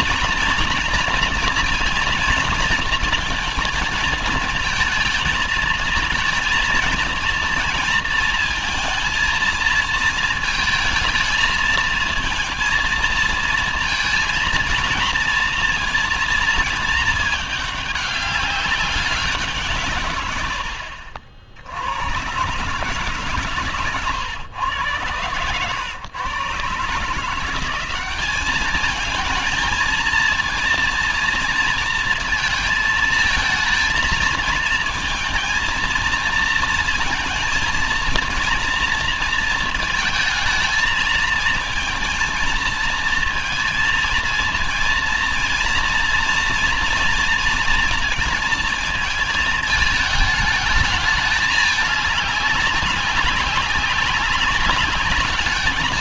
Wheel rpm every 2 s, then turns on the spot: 230, 230, 220, 230, 230, 220, 230, 230, 220, 200, 70, 140, 110, 140, 210, 230, 220, 220, 230, 230, 220, 230, 230, 230, 220, 220, 200, 200.
none